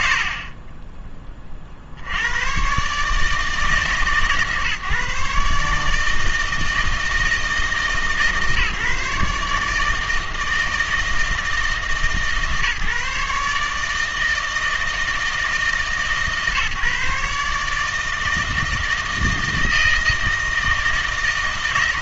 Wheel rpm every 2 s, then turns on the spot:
60, 110, 140, 160, 150, 160, 140, 160, 150, 160, 160.
none